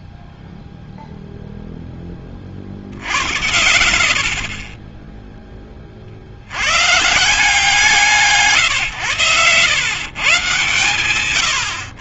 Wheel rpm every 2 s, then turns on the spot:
0, 80, 30, 170, 100, 130.
none